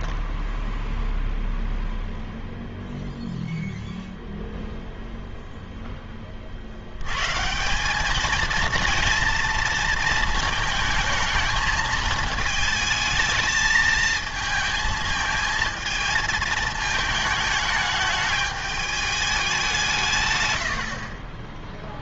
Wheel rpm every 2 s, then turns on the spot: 0, 0, 0, 50, 230, 220, 220, 220, 220, 210, 100.
none